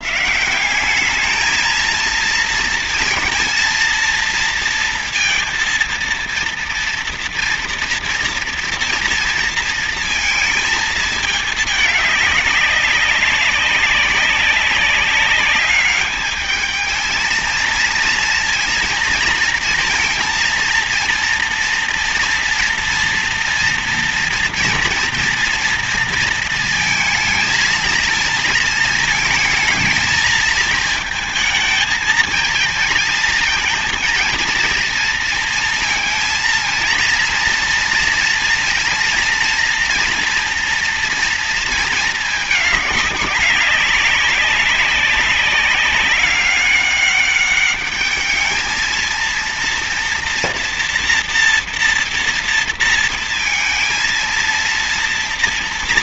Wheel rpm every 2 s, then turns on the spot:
170, 230, 230, 230, 230, 230, 200, 190, 210, 230, 230, 240, 230, 230, 220, 220, 230, 230, 230, 240, 240, 210, 200, 200, 220, 230, 230, 230.
none